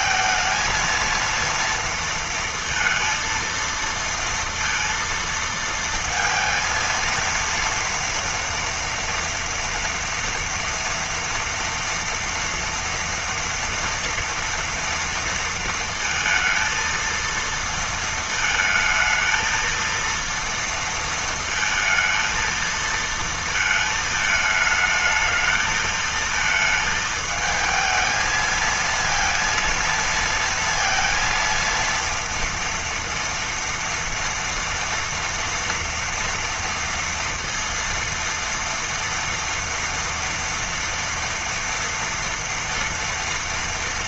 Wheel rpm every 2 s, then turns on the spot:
220, 230, 230, 230, 230, 230, 230, 230, 230, 220, 230, 230, 220, 220, 220, 230, 230, 230, 230, 230, 230, 230.
none